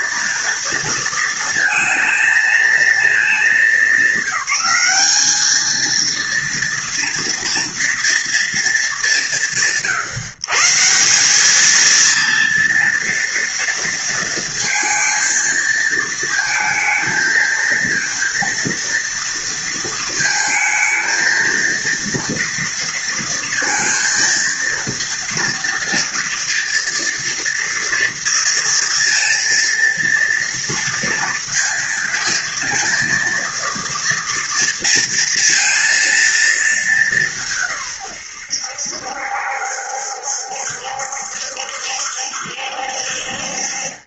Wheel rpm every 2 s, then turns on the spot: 230, 220, 210, 230, 180, 160, 230, 230, 230, 230, 220, 230, 230, 230, 230, 230, 230, 230, 200, 80, 70, 60.
none